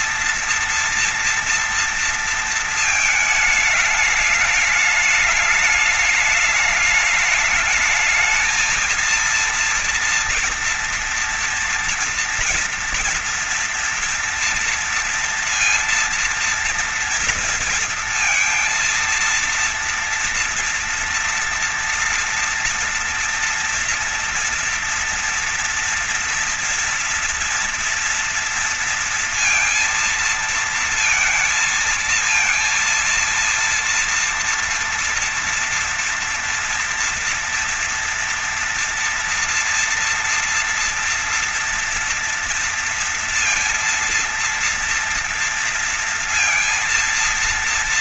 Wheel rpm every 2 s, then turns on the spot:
230, 220, 210, 210, 220, 230, 230, 230, 230, 230, 230, 230, 230, 230, 230, 230, 230, 240, 230, 230, 230, 230, 230, 230.
none